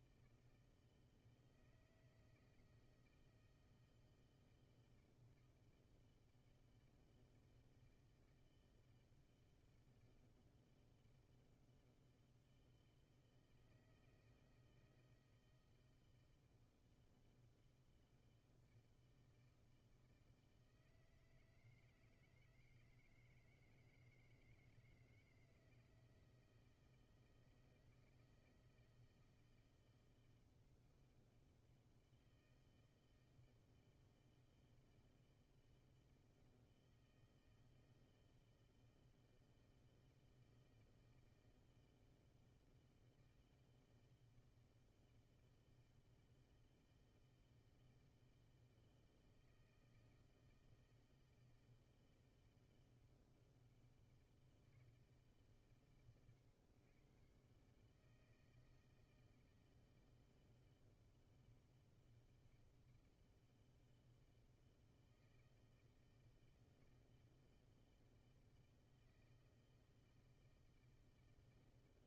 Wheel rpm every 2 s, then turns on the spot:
160, 160, 160, 160, 160, 160, 160, 160, 160, 160, 160, 160, 160, 160, 160, 160, 160, 160, 160, 170, 160, 160, 160, 160, 160, 160, 160, 160, 110, 160, 160, 160, 160, 160, 160, 160.
none